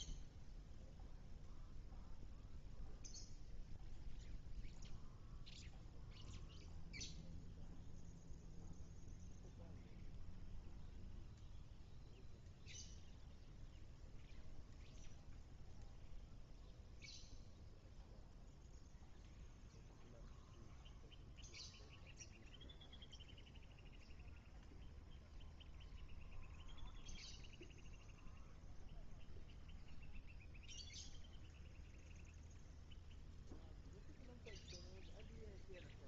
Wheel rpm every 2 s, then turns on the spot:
0, 0, 0, 0, 0, 0, 0, 0, 0, 0, 0, 0, 0, 0, 0, 0, 0, 0.
none